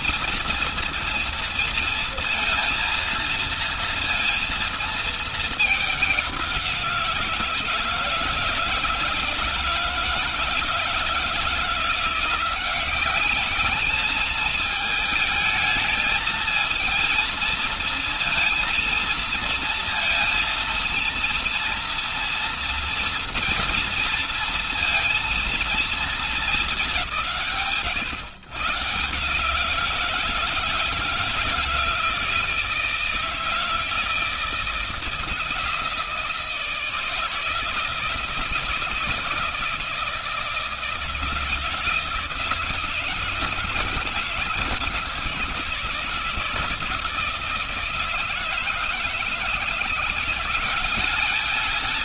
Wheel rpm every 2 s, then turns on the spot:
230, 230, 230, 190, 170, 160, 180, 210, 220, 230, 230, 230, 230, 230, 130, 170, 160, 170, 160, 160, 160, 160, 160, 160, 160, 180.
none